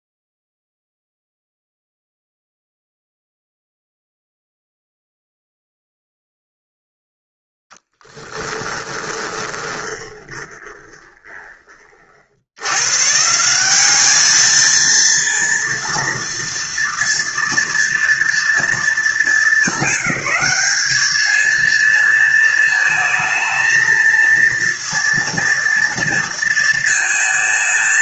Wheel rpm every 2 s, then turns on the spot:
0, 0, 0, 0, 10, 20, 140, 230, 230, 220, 210, 220, 230, 230.
8-12